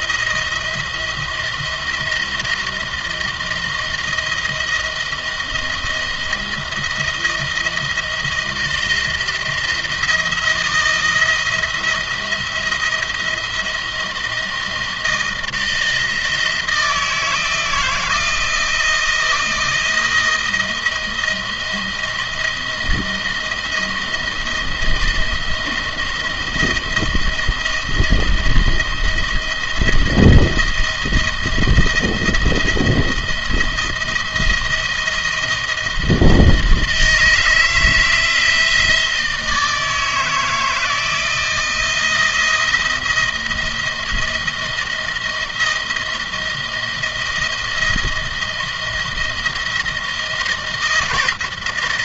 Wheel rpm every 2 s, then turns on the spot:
170, 170, 170, 170, 160, 170, 170, 160, 160, 170, 160, 160, 170, 160, 170, 160, 170, 170, 160, 160, 160, 160, 160, 170, 160, 160.
none